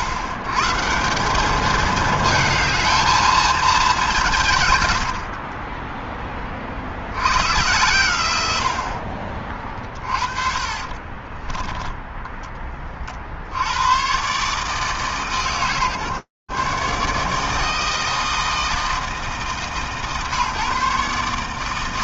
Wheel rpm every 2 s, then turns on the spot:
110, 220, 150, 0, 120, 20, 10, 60, 140, 160, 150.
10-14